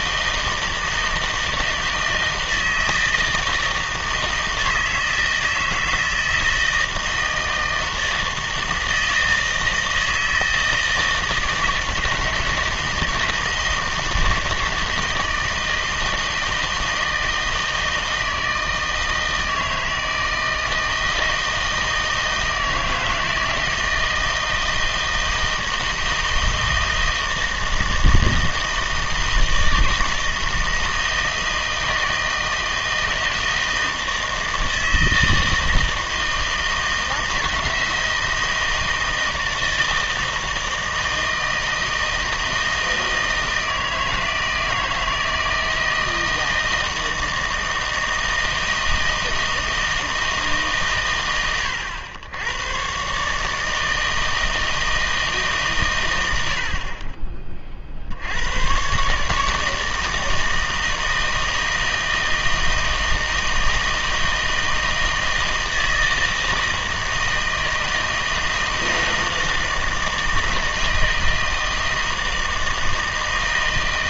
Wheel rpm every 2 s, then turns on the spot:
160, 160, 160, 160, 160, 160, 160, 160, 160, 160, 160, 160, 160, 160, 160, 160, 160, 160, 160, 160, 160, 160, 160, 160, 160, 150, 110, 160, 70, 110, 160, 160, 160, 160, 160, 160, 160.
none